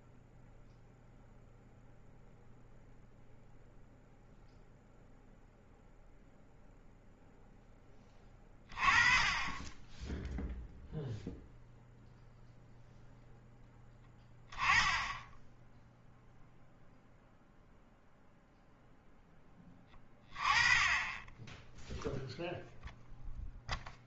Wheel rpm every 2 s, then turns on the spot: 0, 0, 0, 0, 20, 0, 0, 10, 0, 0, 20, 0.
none